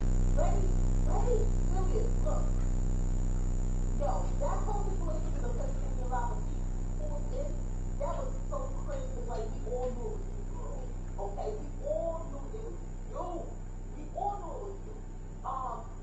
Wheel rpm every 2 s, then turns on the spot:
0, 0, 0, 0, 0, 0, 0, 0.
none